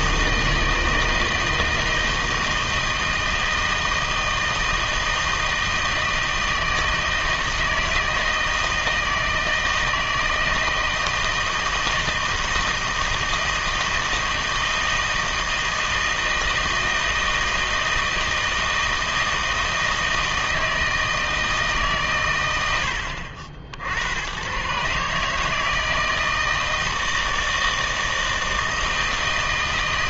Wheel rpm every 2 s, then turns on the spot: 160, 160, 160, 160, 160, 160, 160, 160, 160, 160, 160, 80, 130, 160, 160.
none